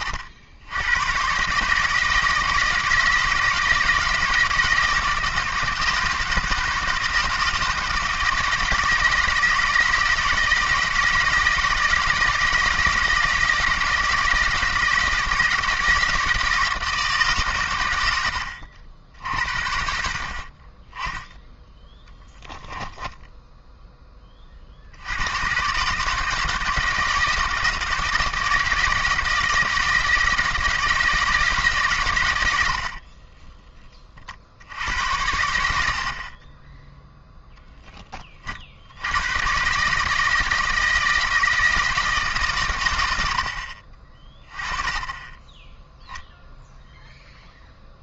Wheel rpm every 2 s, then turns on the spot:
90, 160, 160, 160, 160, 160, 160, 160, 160, 80, 20, 10, 60, 160, 160, 160, 60, 70, 20, 60, 160, 120, 20, 0.
32-34 36-38